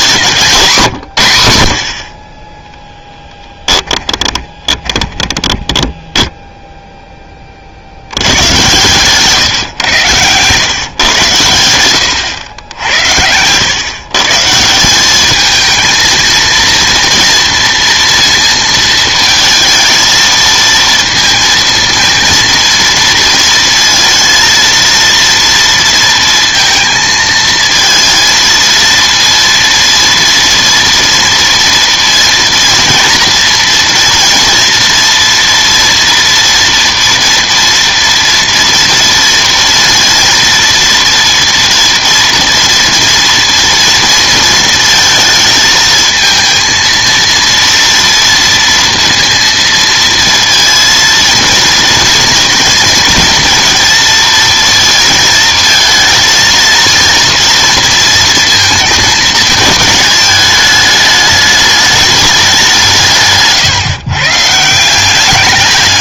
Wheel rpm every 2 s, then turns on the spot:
150, 20, 30, 0, 110, 130, 90, 160, 230, 230, 230, 230, 230, 230, 230, 230, 230, 230, 230, 230, 230, 240, 230, 230, 230, 230, 230, 230, 230, 220, 210, 190, 160.
4-6 12-14